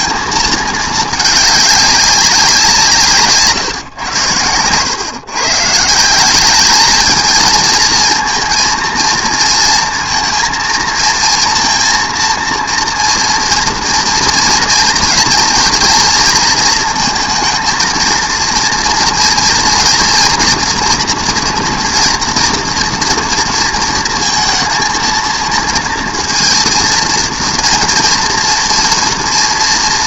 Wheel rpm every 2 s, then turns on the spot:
220, 170, 110, 210, 230, 230, 230, 230, 230, 230, 230, 230, 230, 230, 230.
none